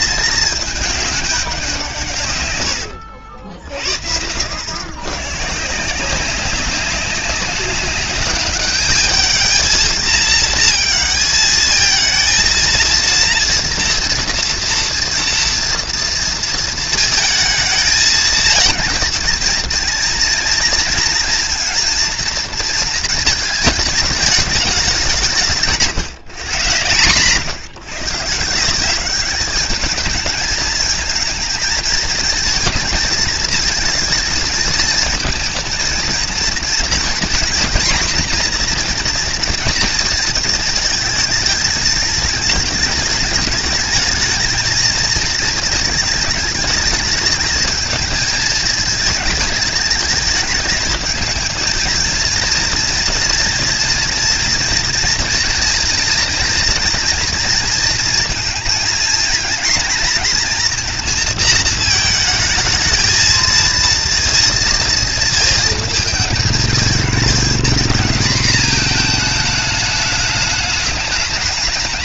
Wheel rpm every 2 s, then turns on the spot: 220, 100, 110, 190, 210, 220, 230, 230, 230, 230, 230, 230, 200, 130, 190, 220, 230, 220, 230, 240, 220, 210, 230, 220, 220, 220, 230, 230, 230, 230, 230, 220, 230, 220, 220, 210.
2-4